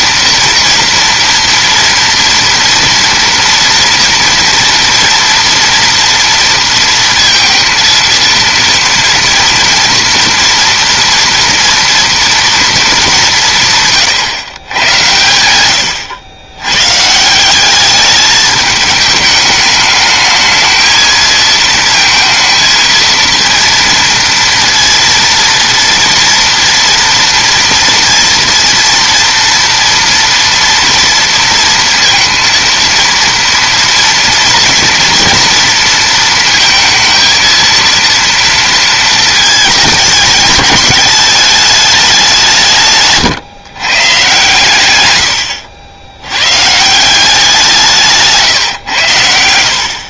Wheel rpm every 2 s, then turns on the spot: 240, 230, 230, 230, 230, 240, 220, 110, 120, 210, 220, 220, 230, 230, 230, 230, 230, 230, 220, 230, 210, 160, 120, 140, 120.
none